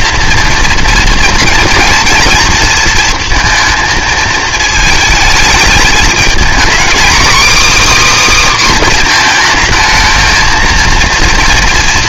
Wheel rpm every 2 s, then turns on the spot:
230, 230, 220, 240, 270, 230.
none